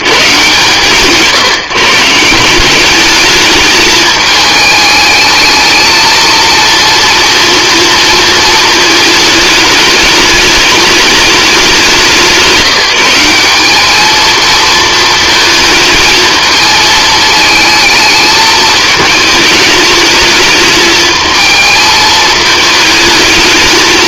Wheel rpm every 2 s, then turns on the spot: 110, 190, 210, 230, 220, 210, 180, 230, 220, 220, 220, 220.
none